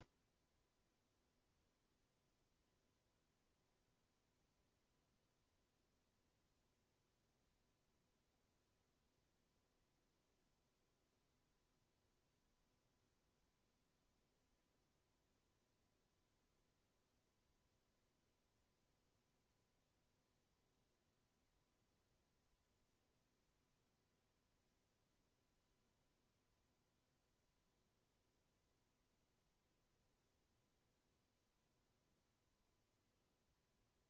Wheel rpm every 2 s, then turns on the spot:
0, 0, 0, 0, 0, 0, 0, 0, 0, 0, 0, 0, 0, 0, 0, 0, 0.
none